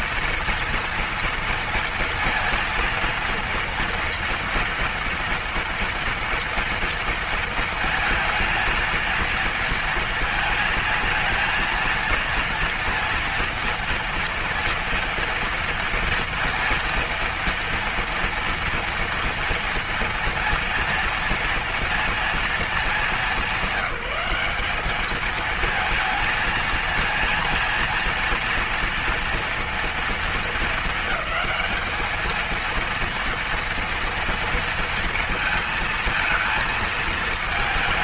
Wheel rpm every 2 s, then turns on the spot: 230, 230, 230, 230, 230, 230, 230, 230, 230, 230, 230, 230, 200, 220, 230, 220, 220, 230, 230.
none